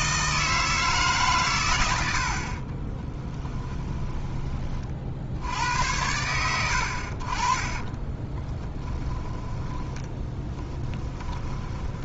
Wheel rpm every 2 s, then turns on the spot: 150, 30, 40, 80, 10, 20.
2-4 8-12